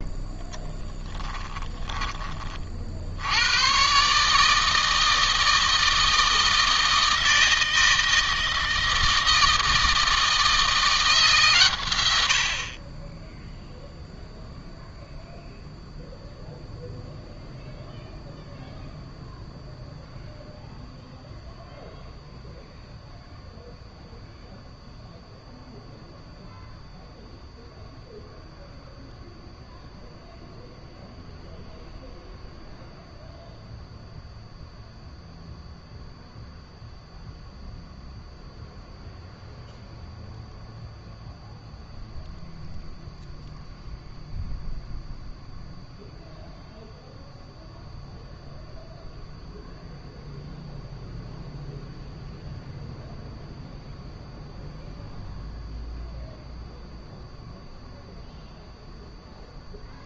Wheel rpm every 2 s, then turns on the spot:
10, 30, 150, 160, 160, 160, 60, 0, 0, 0, 0, 0, 0, 0, 0, 0, 0, 0, 0, 0, 0, 0, 0, 0, 0, 0, 0, 0, 0, 0.
0-2